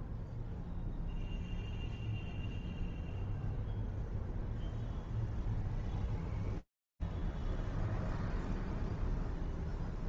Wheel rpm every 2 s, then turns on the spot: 0, 0, 0, 0, 0.
none